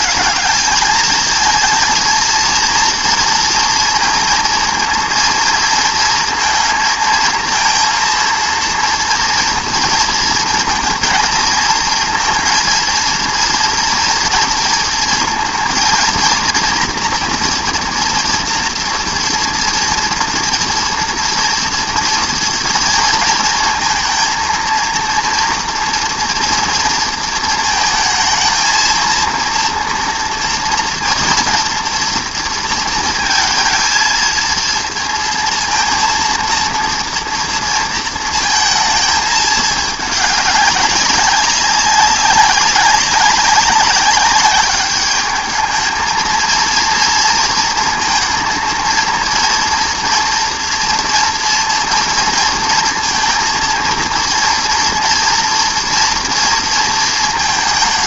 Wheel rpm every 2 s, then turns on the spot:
200, 230, 230, 230, 230, 230, 230, 230, 230, 230, 230, 230, 230, 240, 220, 230, 230, 230, 230, 220, 200, 190, 200, 230, 230, 230, 230, 230, 230.
none